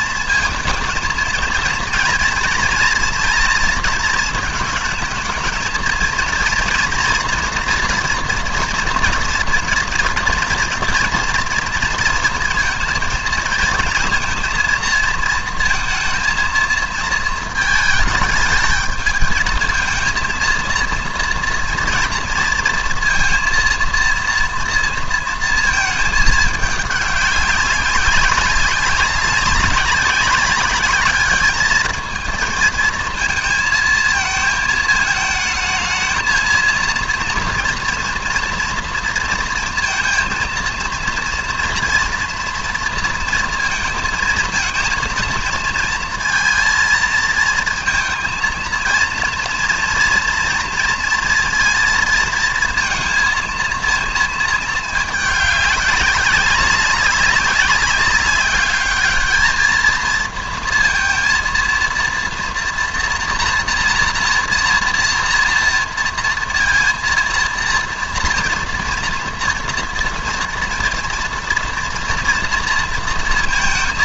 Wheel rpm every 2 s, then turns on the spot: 230, 230, 220, 230, 230, 230, 230, 230, 230, 220, 230, 230, 230, 210, 190, 200, 220, 220, 230, 230, 230, 230, 230, 230, 230, 230, 230, 230, 190, 210, 230, 230, 230, 230, 230, 230, 230.
none